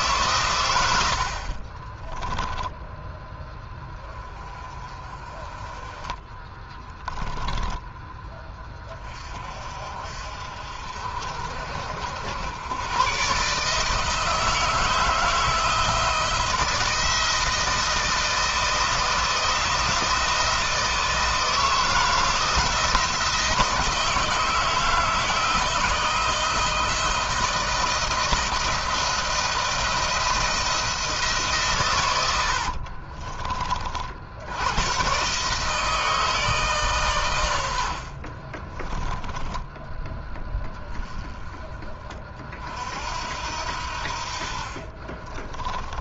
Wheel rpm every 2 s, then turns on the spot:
90, 10, 20, 10, 20, 50, 110, 160, 160, 160, 160, 160, 160, 160, 170, 160, 50, 120, 140, 20, 10, 60, 40.
6-8 32-34 38-40 44-46